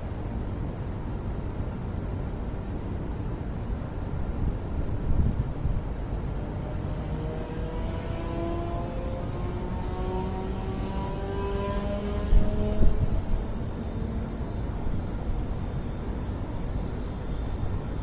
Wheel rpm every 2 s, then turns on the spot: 0, 0, 0, 0, 0, 0, 0, 0, 0.
none